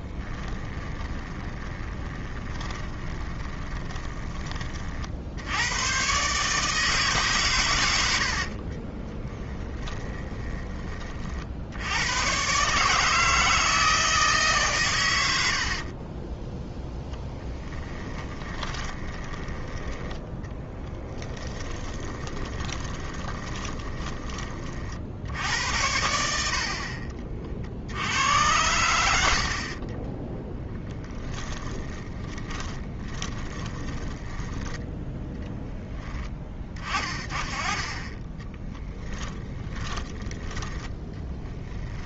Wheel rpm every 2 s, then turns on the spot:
20, 20, 50, 150, 30, 30, 150, 110, 10, 20, 20, 20, 50, 30, 90, 10, 10, 10, 30, 10, 10.
0-4 8-10 18-24 30-34 38-40